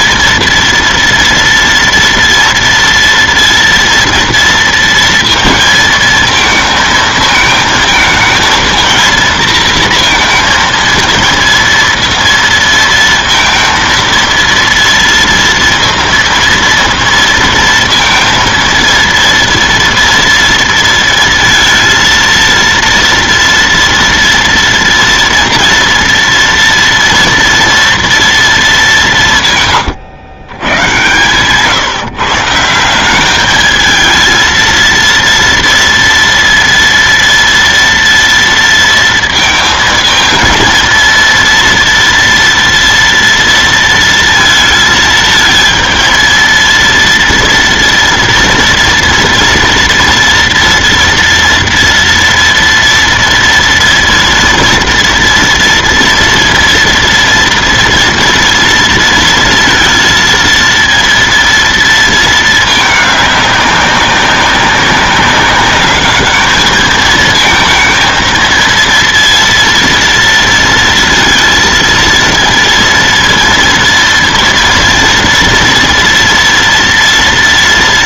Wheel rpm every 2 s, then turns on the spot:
230, 230, 230, 230, 230, 230, 230, 230, 230, 230, 230, 230, 230, 230, 210, 120, 170, 230, 230, 230, 230, 230, 230, 230, 230, 230, 240, 230, 230, 230, 230, 220, 200, 220, 230, 230, 230, 230, 230.
none